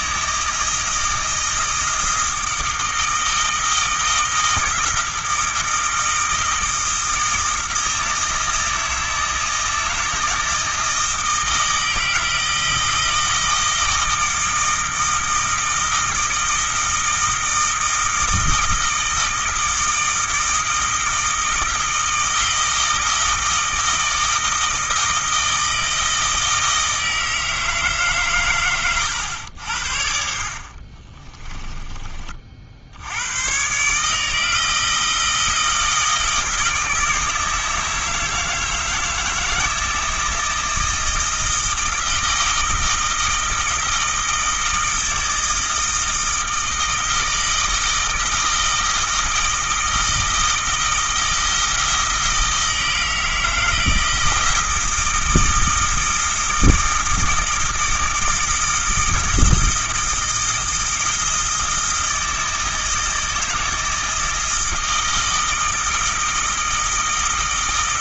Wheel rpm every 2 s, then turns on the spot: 160, 160, 160, 160, 160, 160, 160, 160, 160, 160, 160, 160, 160, 160, 120, 50, 70, 160, 160, 160, 160, 160, 160, 160, 160, 160, 160, 160, 160, 160, 160, 160, 160, 160.
30-32